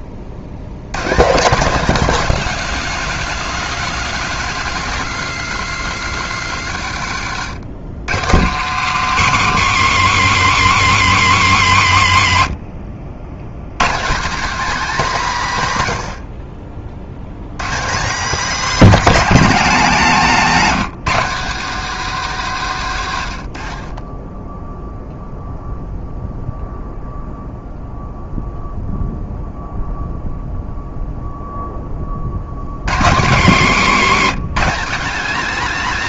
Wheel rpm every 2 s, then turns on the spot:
130, 180, 130, 80, 170, 180, 70, 230, 40, 210, 190, 160, 0, 0, 0, 0, 120, 200.
none